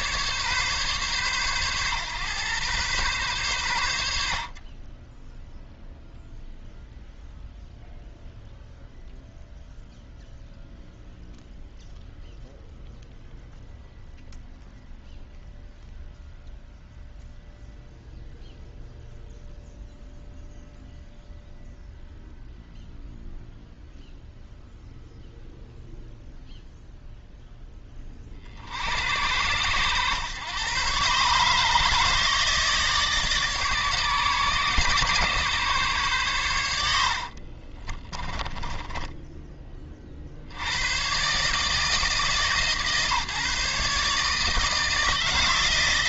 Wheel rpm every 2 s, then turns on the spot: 130, 120, 20, 0, 0, 0, 0, 0, 0, 0, 0, 0, 0, 0, 70, 130, 150, 130, 70, 10, 110, 150, 160.
36-40